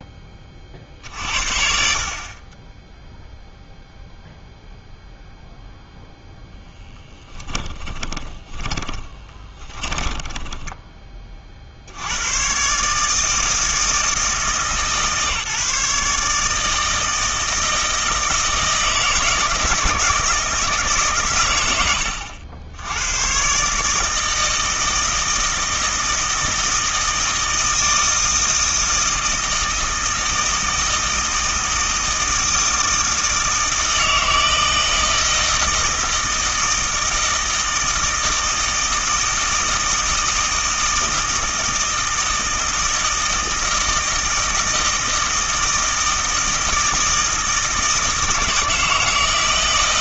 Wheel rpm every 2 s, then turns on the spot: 40, 10, 0, 10, 20, 20, 140, 150, 160, 160, 150, 90, 160, 160, 160, 160, 160, 160, 160, 160, 160, 160, 160, 160, 160.
6-12